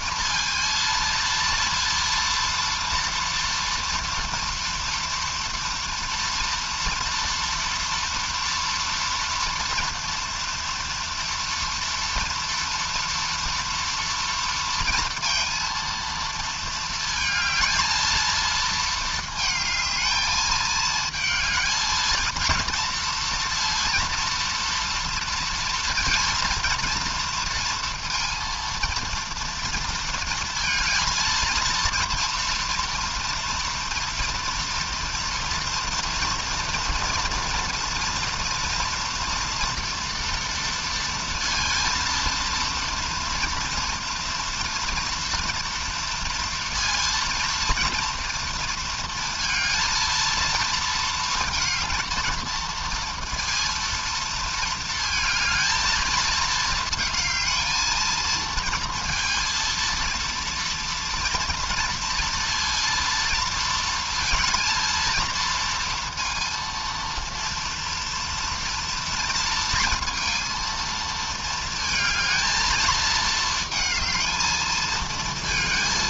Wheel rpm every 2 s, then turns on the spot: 230, 230, 230, 230, 230, 230, 230, 230, 220, 220, 220, 230, 230, 220, 230, 220, 230, 230, 230, 230, 230, 230, 230, 230, 230, 230, 230, 230, 220, 230, 230, 230, 230, 230, 230, 230, 220, 220.
none